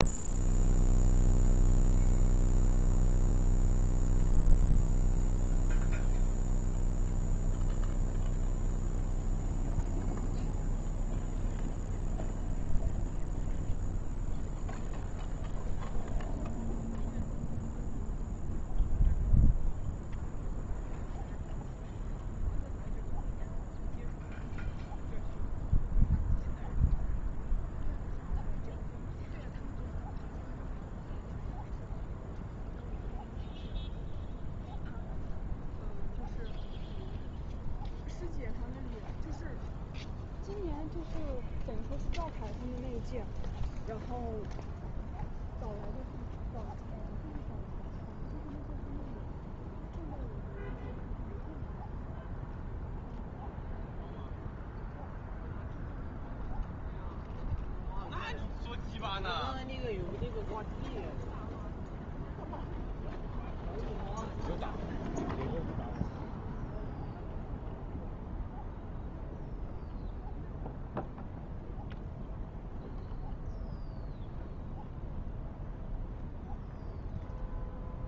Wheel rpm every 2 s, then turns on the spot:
0, 0, 0, 0, 0, 0, 0, 0, 0, 0, 0, 0, 0, 0, 0, 0, 0, 0, 0, 0, 0, 0, 0, 0, 0, 0, 0, 0, 0, 0, 0, 0, 0, 0, 0, 0, 0, 0, 0.
none